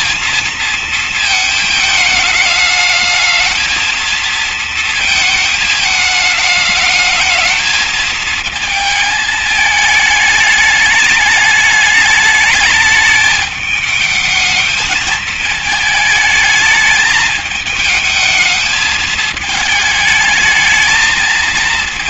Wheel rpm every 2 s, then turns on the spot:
230, 210, 230, 210, 220, 210, 210, 220, 220, 220, 210.
none